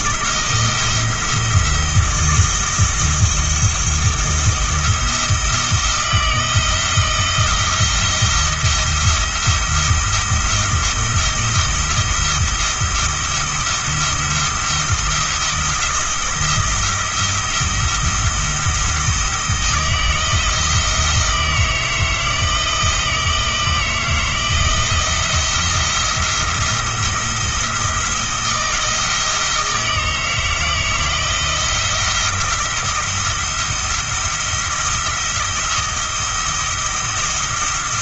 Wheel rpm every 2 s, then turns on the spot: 170, 170, 170, 170, 170, 170, 170, 170, 170, 170, 160, 160, 160, 170, 160, 160, 170, 170, 170.
none